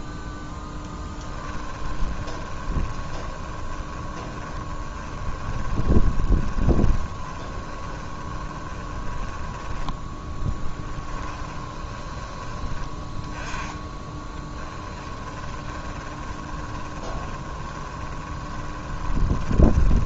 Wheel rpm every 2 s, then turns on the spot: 0, 20, 20, 20, 10, 10, 10, 20, 20, 20.
2-20